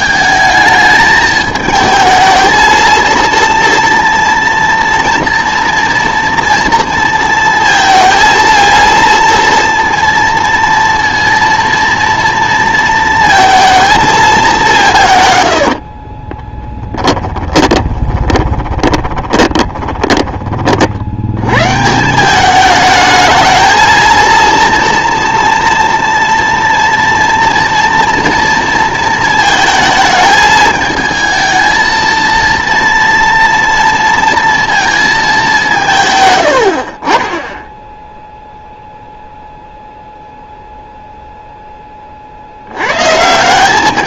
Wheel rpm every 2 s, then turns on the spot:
220, 230, 240, 230, 230, 230, 230, 160, 10, 20, 50, 210, 230, 230, 230, 220, 230, 230, 50, 0, 0, 110.
16-20